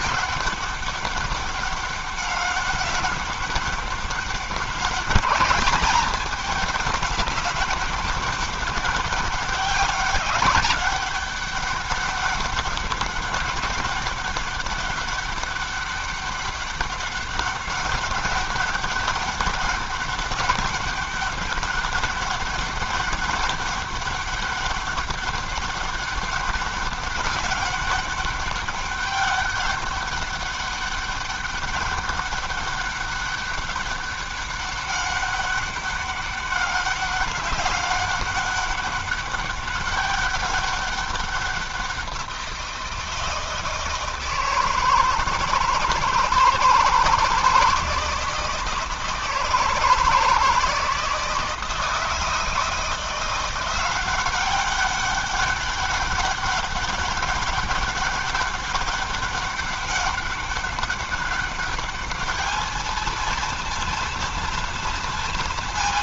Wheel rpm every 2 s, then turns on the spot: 200, 200, 200, 210, 200, 200, 200, 200, 200, 200, 200, 200, 200, 200, 200, 200, 200, 200, 200, 200, 200, 170, 160, 160, 160, 160, 160, 190, 200, 200, 200, 220, 230.
none